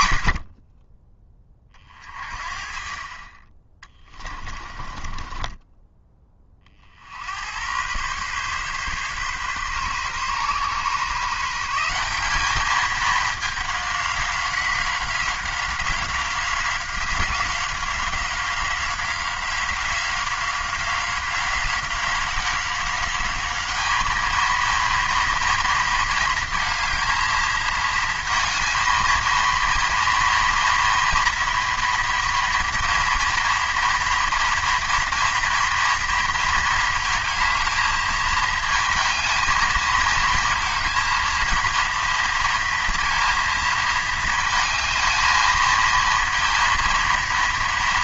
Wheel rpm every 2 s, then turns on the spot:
20, 40, 30, 50, 130, 140, 210, 190, 190, 190, 180, 190, 230, 220, 230, 230, 230, 230, 230, 220, 230, 230, 220, 230.
4-6